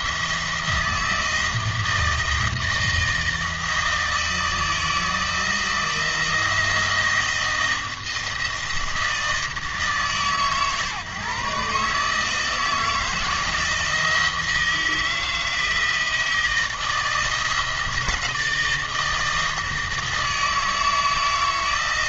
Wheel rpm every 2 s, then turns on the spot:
160, 160, 160, 170, 160, 140, 160, 160, 160, 160, 160.
none